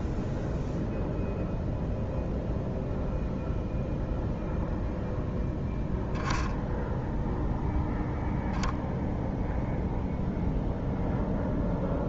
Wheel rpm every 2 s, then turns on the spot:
0, 0, 0, 0, 0, 0.
none